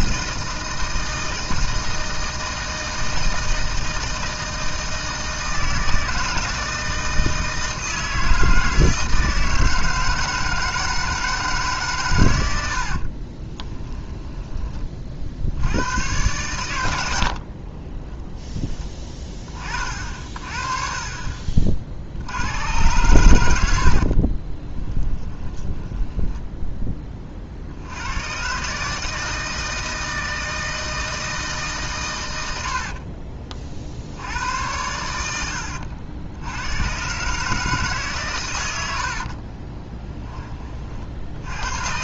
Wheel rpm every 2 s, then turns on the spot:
160, 160, 160, 160, 160, 160, 80, 20, 100, 10, 50, 90, 20, 10, 150, 160, 90, 90, 100, 110, 30.
24-28 32-34